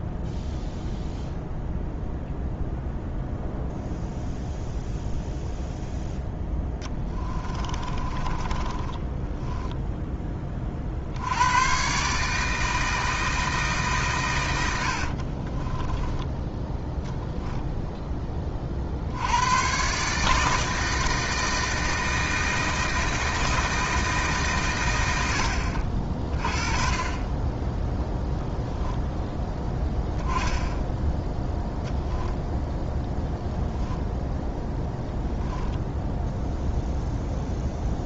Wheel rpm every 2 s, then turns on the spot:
0, 0, 0, 10, 20, 50, 160, 80, 10, 50, 160, 160, 100, 40, 0, 10, 0, 0, 0.
6-10 14-16